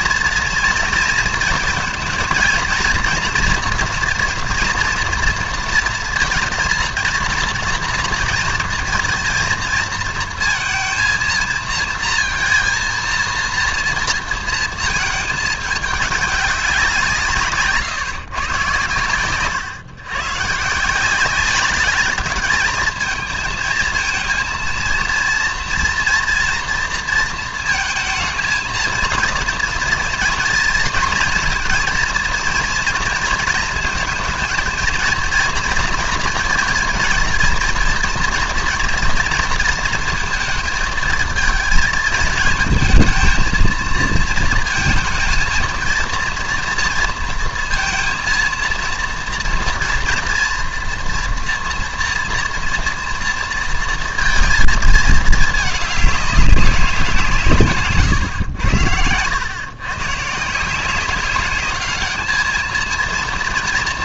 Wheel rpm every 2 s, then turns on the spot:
230, 240, 240, 230, 220, 230, 230, 230, 190, 120, 140, 210, 230, 230, 220, 230, 240, 230, 230, 230, 220, 220, 230, 240, 230, 230, 230, 230, 200, 90, 160, 220.
none